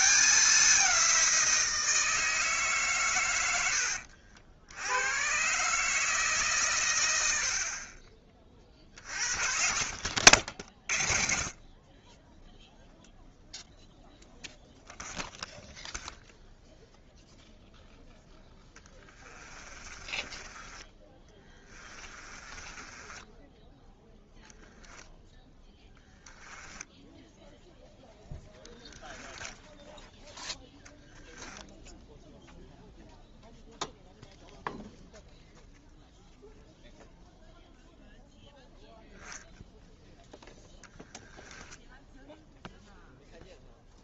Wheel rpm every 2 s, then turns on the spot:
190, 150, 80, 120, 40, 40, 0, 0, 0, 10, 20, 20, 0, 10, 10, 0, 0, 0, 0, 0, 0, 0.
18-24 26-30